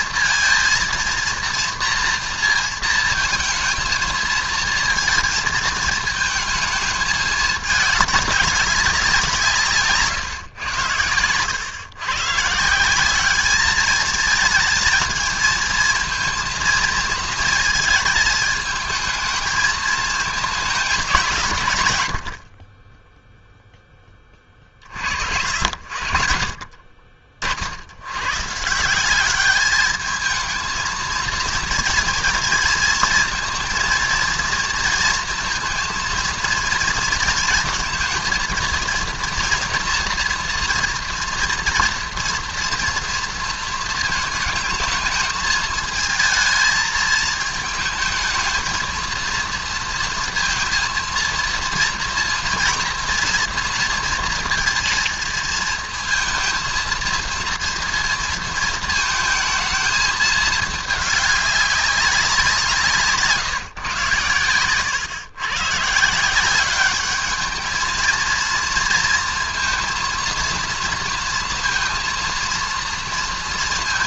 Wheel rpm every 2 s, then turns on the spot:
230, 230, 220, 210, 200, 100, 180, 220, 230, 220, 200, 20, 50, 40, 170, 230, 230, 230, 230, 230, 230, 230, 220, 220, 230, 230, 230, 230, 230, 220, 220, 170, 120, 200, 230, 230, 230.
22-24